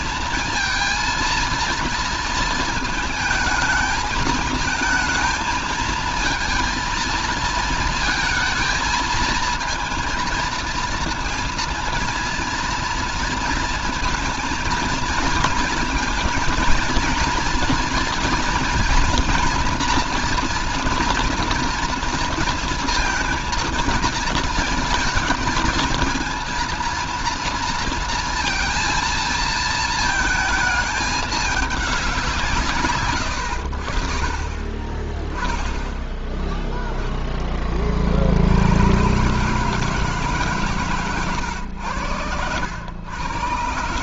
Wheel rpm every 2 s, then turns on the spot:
230, 230, 220, 230, 220, 230, 230, 230, 230, 230, 230, 230, 230, 230, 230, 220, 160, 20, 0, 70, 140, 100.
none